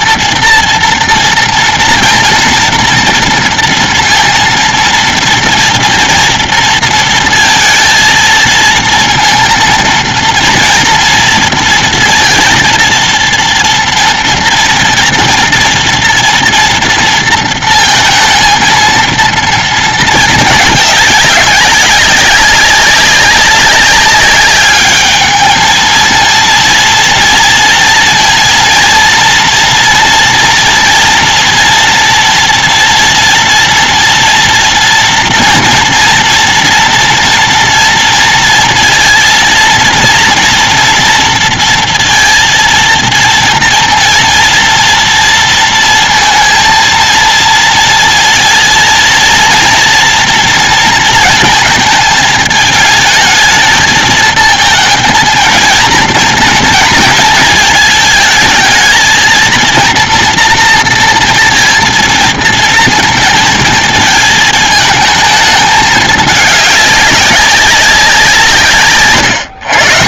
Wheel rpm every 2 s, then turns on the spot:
230, 230, 230, 230, 230, 230, 230, 230, 230, 230, 220, 200, 200, 230, 240, 240, 230, 230, 230, 230, 230, 230, 230, 230, 230, 230, 220, 220, 230, 220, 230, 230, 220, 210, 190.
none